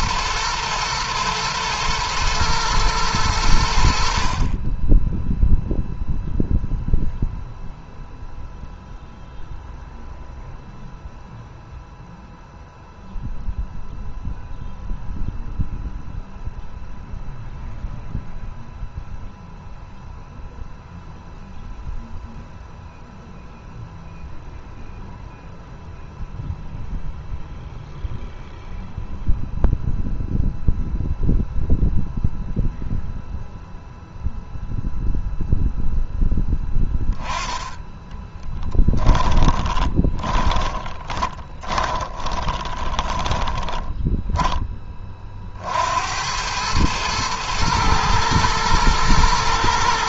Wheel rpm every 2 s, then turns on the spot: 110, 110, 20, 0, 0, 0, 0, 0, 0, 0, 0, 0, 0, 0, 0, 0, 0, 0, 10, 10, 10, 20, 20, 100, 110.
38-44